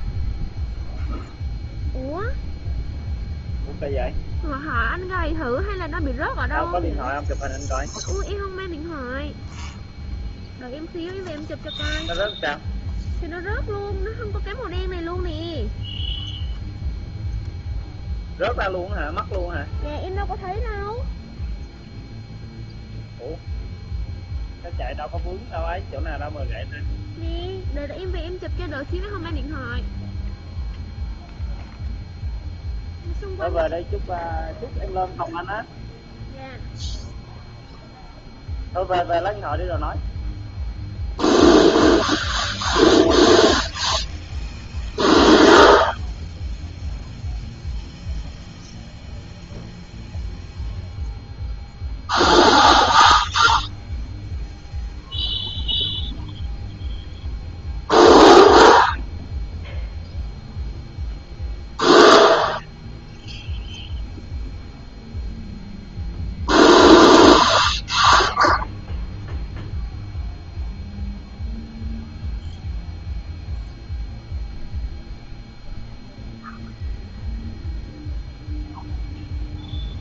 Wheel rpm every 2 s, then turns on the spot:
0, 0, 0, 0, 0, 0, 0, 0, 0, 0, 0, 0, 0, 0, 0, 0, 0, 0, 0, 0, 0, 0, 0, 0, 0, 0, 0, 0, 0, 0, 0, 0, 0, 0, 0, 0, 0, 0, 0, 0.
none